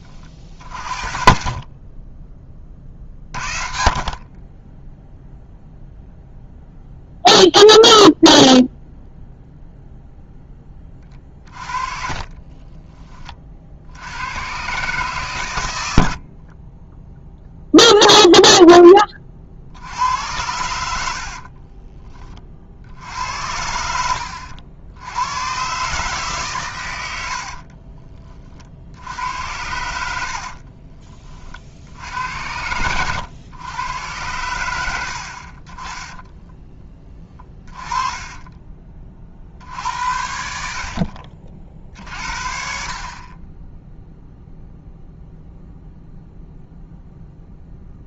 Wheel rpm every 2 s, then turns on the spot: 50, 30, 0, 0, 0, 10, 30, 120, 30, 0, 90, 50, 80, 130, 50, 40, 80, 90, 10, 20, 60, 50, 0, 0.
12-14 16-18 30-32